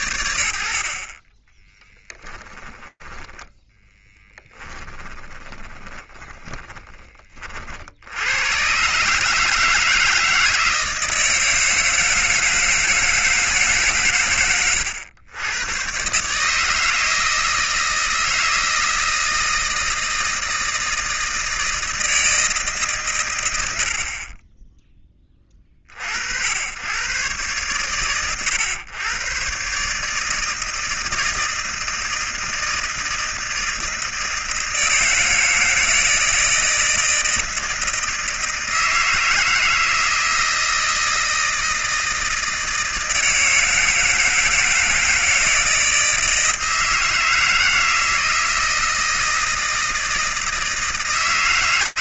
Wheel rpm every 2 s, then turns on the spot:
70, 20, 20, 20, 130, 160, 160, 100, 160, 160, 160, 140, 10, 80, 120, 160, 160, 160, 160, 160, 160, 160, 160, 160, 160, 160.
2-6